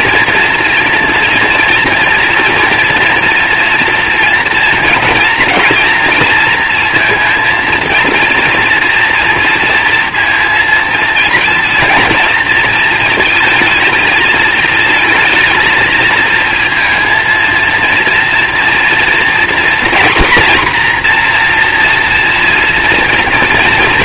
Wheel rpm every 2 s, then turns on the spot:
230, 230, 230, 230, 230, 230, 230, 220, 230, 240, 240, 230.
none